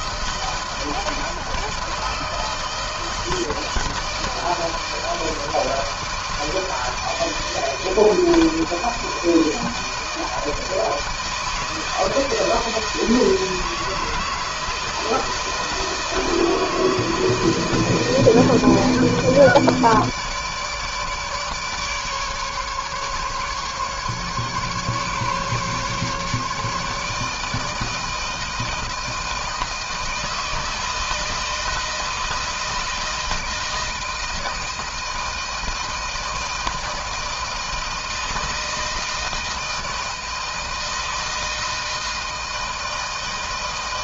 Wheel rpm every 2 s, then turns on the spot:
160, 160, 160, 160, 160, 160, 160, 160, 160, 160, 150, 140, 140, 150, 160, 160, 160, 160, 160, 160, 160, 160.
none